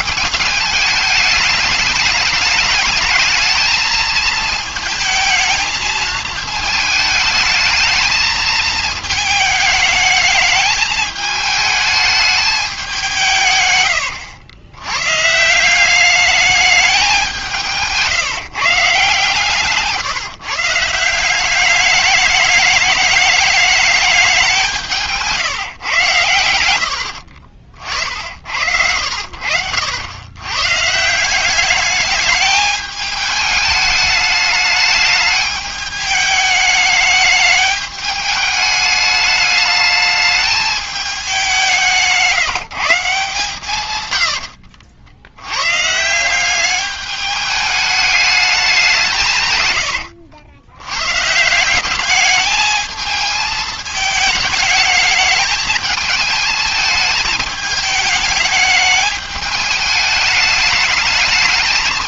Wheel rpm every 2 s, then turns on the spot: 210, 210, 220, 220, 220, 210, 210, 90, 210, 140, 160, 210, 180, 80, 70, 130, 210, 210, 210, 210, 210, 160, 70, 190, 190, 90, 220, 210, 220, 210, 210.
44-46